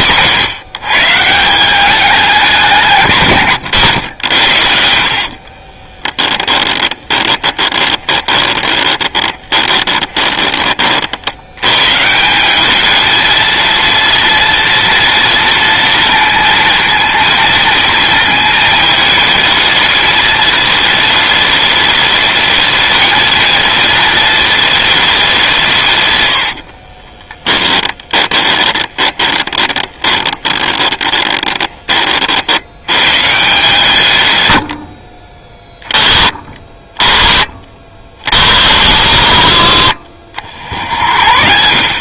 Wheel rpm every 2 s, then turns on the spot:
140, 160, 70, 20, 20, 40, 210, 230, 230, 220, 210, 220, 210, 50, 20, 20, 90, 70, 30, 90, 70.
4-10 26-32